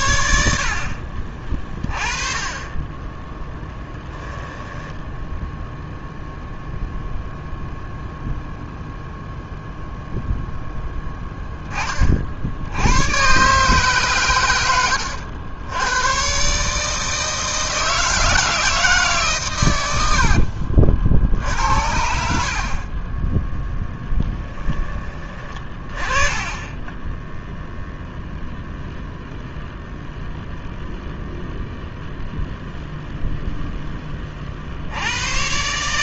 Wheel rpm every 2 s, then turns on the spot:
50, 20, 10, 0, 0, 10, 100, 90, 150, 150, 50, 40, 20, 20, 0, 0, 0, 80.
4-6 22-24